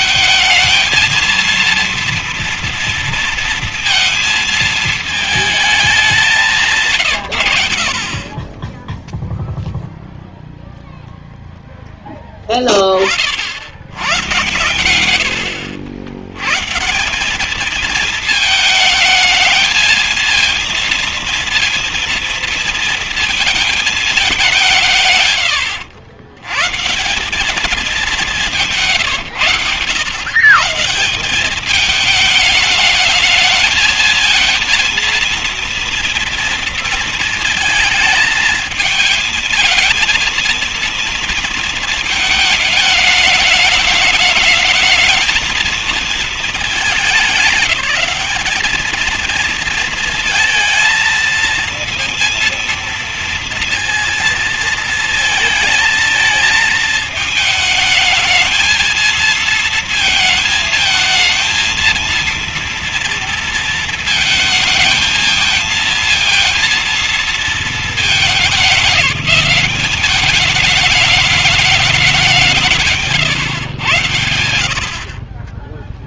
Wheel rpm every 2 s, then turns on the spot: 230, 230, 220, 160, 10, 0, 20, 110, 140, 220, 230, 230, 180, 150, 170, 150, 210, 230, 230, 220, 230, 220, 220, 200, 210, 230, 230, 220, 220, 220, 220, 230, 220, 230, 210, 210, 180, 80.
none